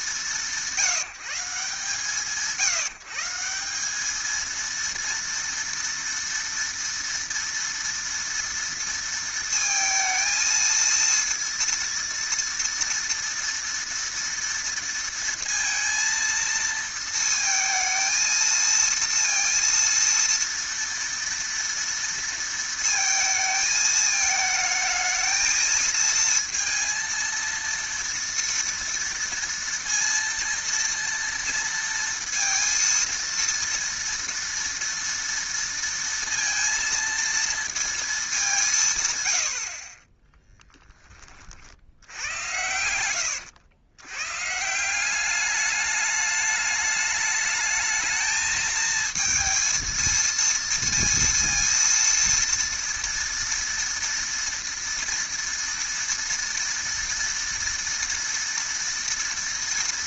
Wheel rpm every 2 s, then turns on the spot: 140, 140, 230, 230, 230, 230, 230, 230, 230, 230, 230, 230, 220, 230, 230, 230, 230, 230, 230, 190, 10, 90, 140, 210, 220, 230, 230, 230, 230, 230.
none